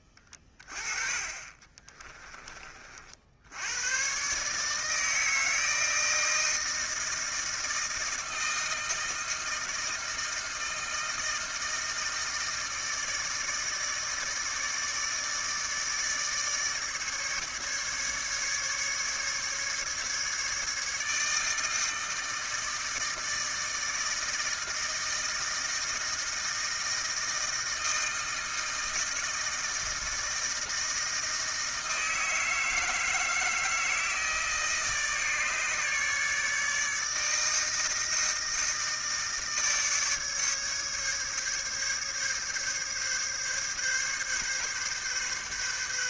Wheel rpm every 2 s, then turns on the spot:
20, 30, 140, 160, 160, 160, 160, 150, 150, 150, 150, 160, 160, 160, 160, 160, 160, 160, 150, 160, 150, 140, 140.
0-2